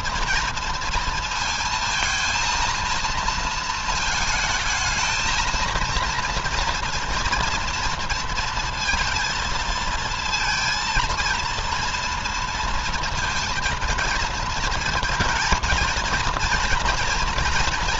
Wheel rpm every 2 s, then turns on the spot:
230, 230, 220, 240, 230, 230, 230, 230, 230.
none